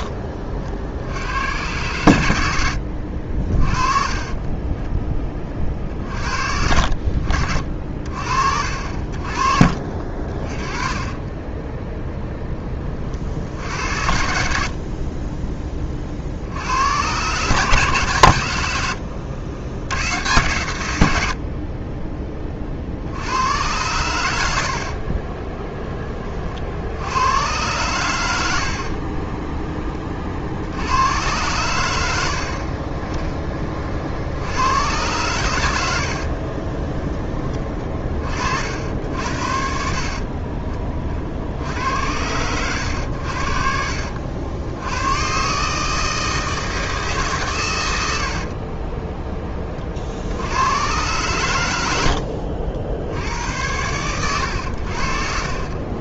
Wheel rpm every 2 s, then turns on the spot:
60, 70, 10, 50, 50, 20, 30, 50, 100, 90, 100, 60, 50, 70, 50, 80, 20, 100, 20, 70, 30, 90, 90, 160, 30, 110, 70, 70.
2-4 10-12 24-26 28-30 48-50